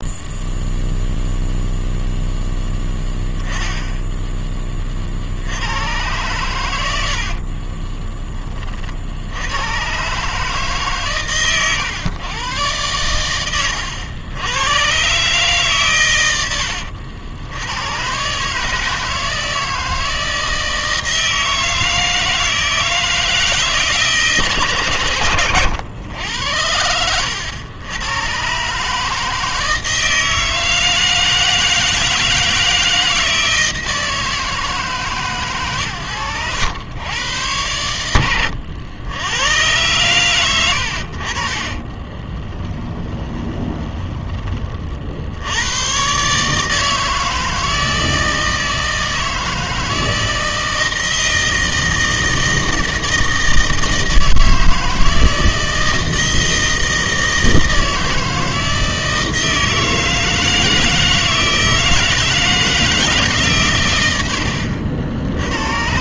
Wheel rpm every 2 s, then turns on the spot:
0, 10, 20, 100, 40, 140, 110, 110, 80, 150, 160, 160, 140, 90, 130, 160, 160, 150, 100, 90, 90, 20, 30, 150, 160, 160, 160, 160, 160, 160, 160, 160, 70.
42-44